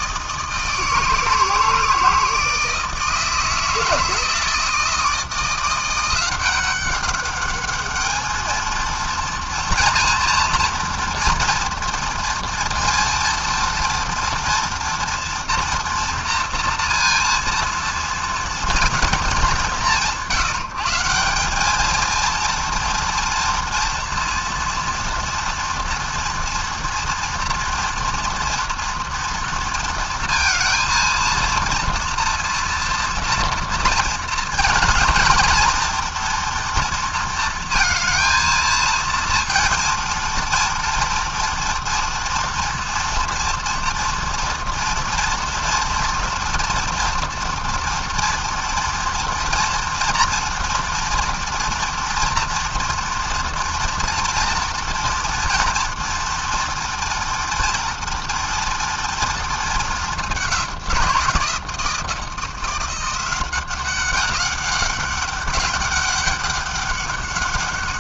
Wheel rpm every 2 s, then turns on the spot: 160, 160, 160, 200, 230, 230, 230, 240, 230, 220, 170, 230, 230, 230, 230, 230, 230, 230, 230, 230, 230, 230, 230, 230, 230, 230, 230, 230, 230, 230, 170, 180, 200, 200.
none